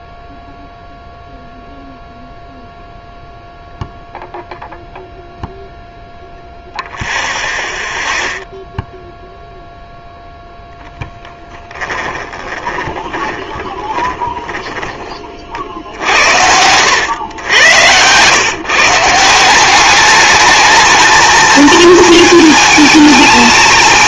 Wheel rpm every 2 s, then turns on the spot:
0, 0, 0, 0, 0, 0, 20, 20, 90, 140, 220, 220.
12-16